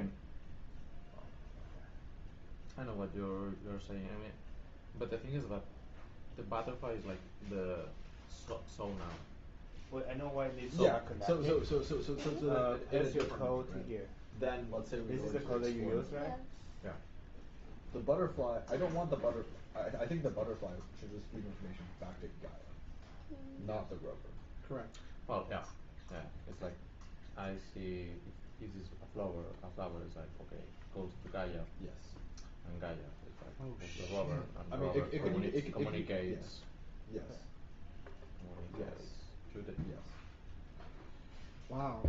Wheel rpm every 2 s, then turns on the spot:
0, 0, 0, 0, 0, 0, 0, 0, 0, 0, 0, 0, 0, 0, 0, 0, 0, 0, 0, 0, 0.
none